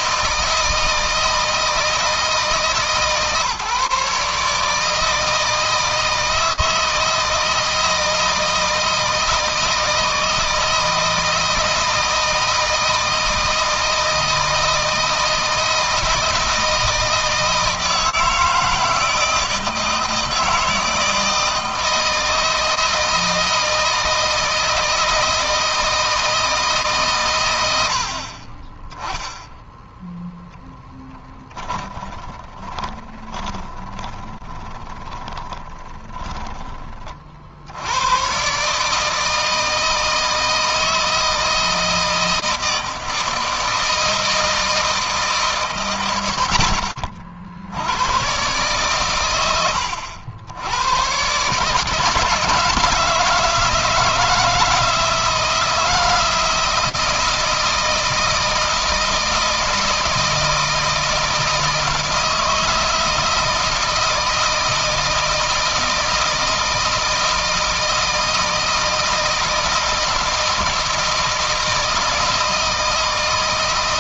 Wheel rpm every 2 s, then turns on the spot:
160, 150, 160, 160, 160, 160, 160, 160, 160, 160, 160, 160, 160, 140, 20, 10, 20, 20, 30, 150, 160, 160, 160, 60, 120, 110, 160, 160, 170, 160, 160, 160, 160, 160, 160, 160, 160.
30-36